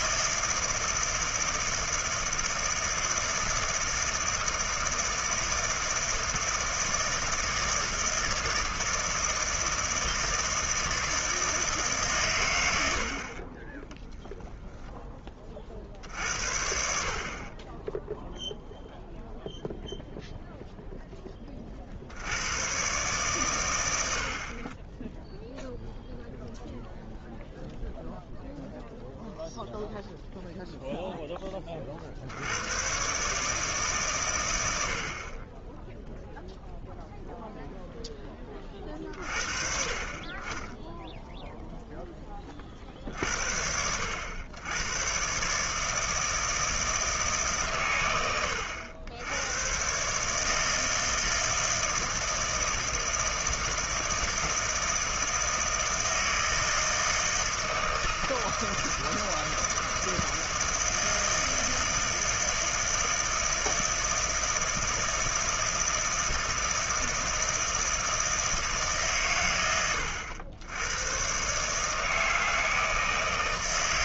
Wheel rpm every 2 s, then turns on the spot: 160, 160, 160, 160, 160, 160, 110, 0, 60, 0, 0, 110, 30, 0, 0, 0, 50, 120, 0, 10, 30, 20, 80, 160, 100, 150, 160, 160, 160, 160, 160, 160, 160, 160, 160, 90, 160.
none